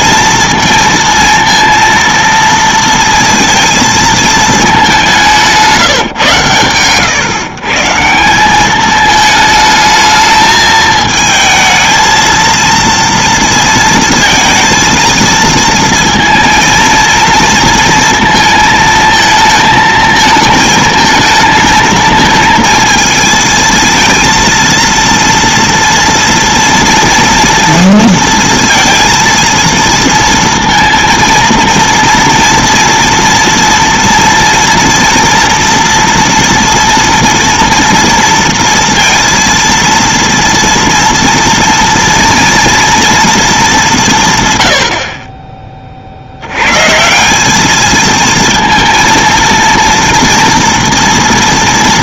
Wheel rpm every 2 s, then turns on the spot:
230, 230, 210, 130, 200, 220, 230, 230, 230, 220, 220, 230, 230, 230, 230, 230, 230, 230, 230, 230, 230, 240, 110, 100, 230, 230.
none